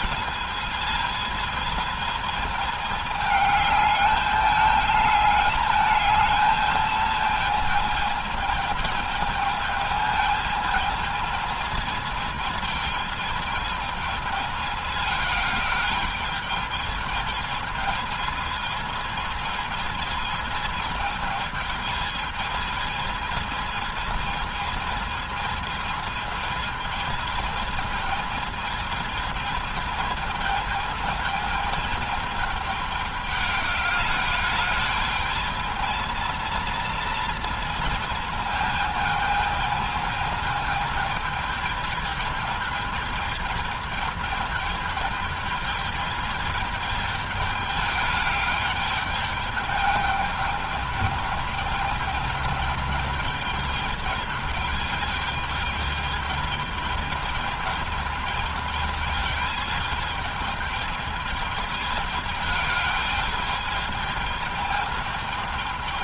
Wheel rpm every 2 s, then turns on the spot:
220, 220, 210, 220, 220, 220, 220, 220, 220, 220, 220, 220, 220, 220, 220, 220, 210, 210, 230, 220, 220, 220, 220, 210, 210, 210, 210, 210, 210, 210, 210, 210, 210.
none